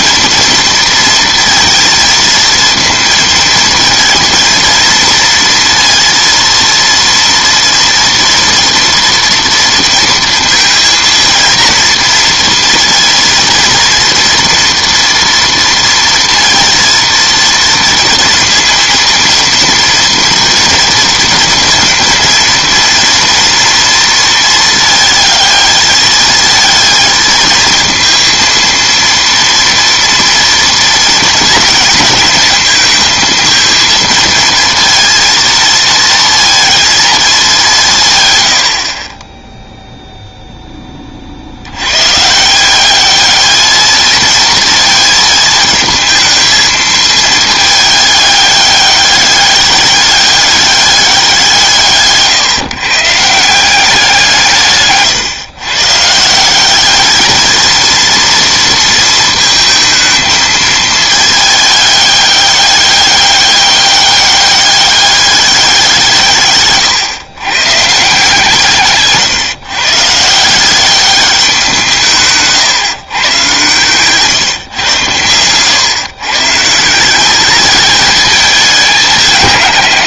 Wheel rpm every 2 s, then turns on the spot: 230, 230, 230, 230, 230, 230, 230, 240, 230, 230, 230, 220, 230, 220, 230, 230, 230, 220, 220, 100, 10, 180, 230, 220, 200, 200, 140, 160, 180, 230, 220, 200, 200, 140, 160, 170, 140, 130, 140, 210.
74-76